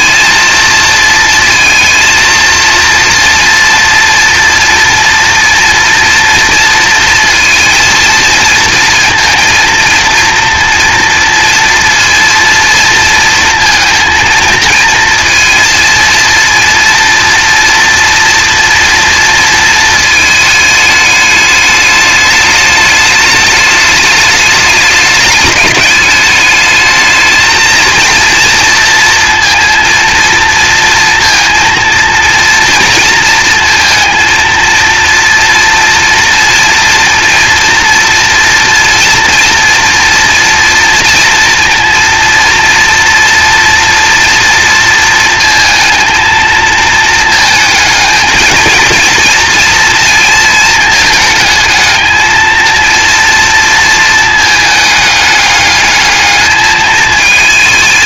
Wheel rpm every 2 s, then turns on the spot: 230, 230, 230, 230, 230, 230, 230, 220, 230, 230, 210, 210, 210, 210, 230, 230, 230, 230, 230, 230, 230, 230, 230, 220, 220, 230, 230, 220, 220.
none